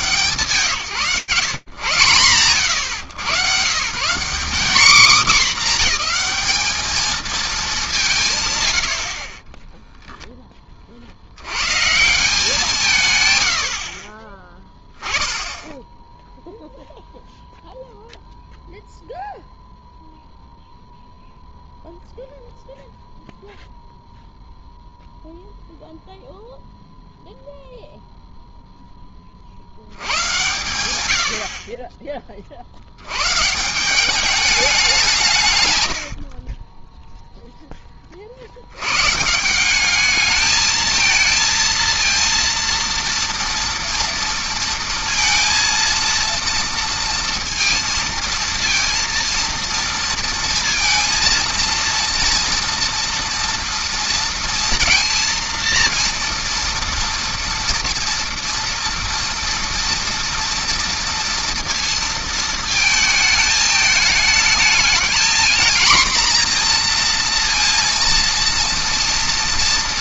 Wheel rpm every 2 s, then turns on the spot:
110, 150, 230, 180, 0, 130, 60, 10, 0, 0, 0, 0, 0, 0, 100, 20, 190, 100, 20, 200, 230, 230, 230, 230, 230, 230, 230, 230, 230, 230, 230, 210, 230, 230, 230.
none